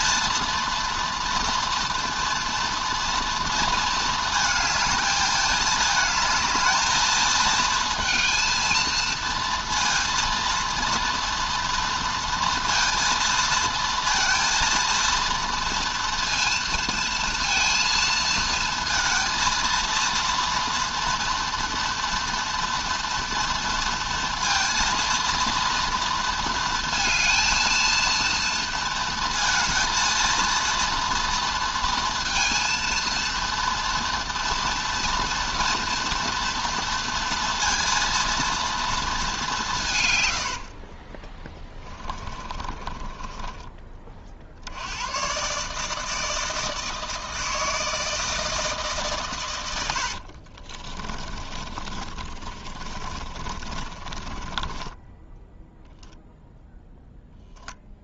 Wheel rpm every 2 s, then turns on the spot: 230, 230, 220, 220, 230, 230, 230, 230, 230, 230, 230, 230, 230, 230, 220, 230, 230, 240, 230, 220, 30, 20, 120, 160, 140, 40, 30, 10, 10.
40-44 50-56